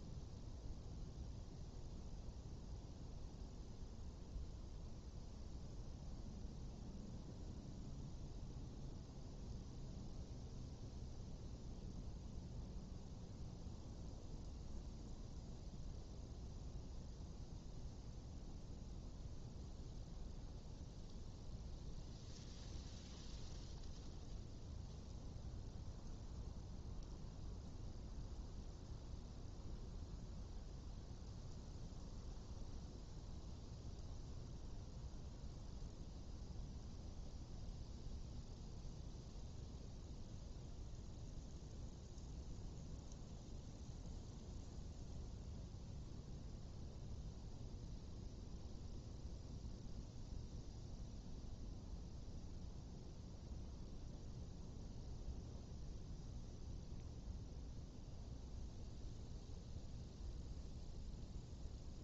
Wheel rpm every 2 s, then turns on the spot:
0, 0, 0, 0, 0, 0, 0, 0, 0, 0, 0, 0, 0, 0, 0, 0, 0, 0, 0, 0, 0, 0, 0, 0, 0, 0, 0, 0, 0, 0, 0.
none